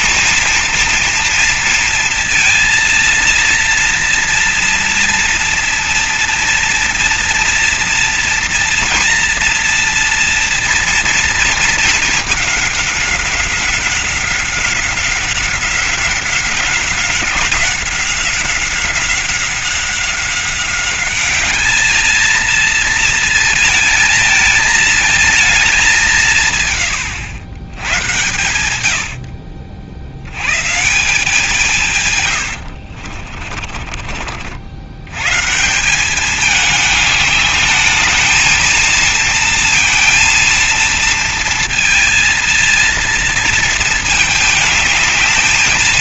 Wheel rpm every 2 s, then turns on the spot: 230, 230, 230, 230, 230, 230, 200, 190, 190, 190, 190, 220, 220, 130, 90, 140, 70, 70, 210, 230, 230, 230, 220.
32-34